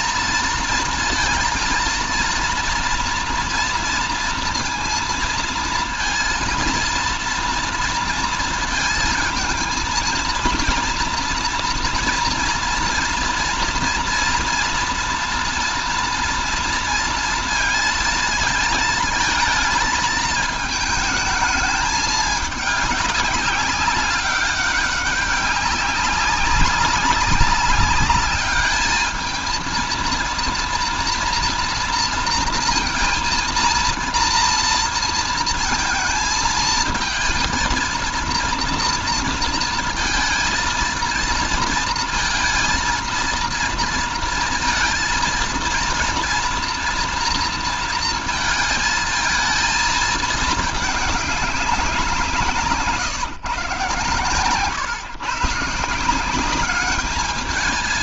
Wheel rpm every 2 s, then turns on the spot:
230, 230, 230, 230, 230, 230, 230, 230, 230, 230, 220, 200, 200, 190, 210, 230, 230, 230, 220, 230, 230, 230, 230, 230, 220, 210, 150, 130, 200.
none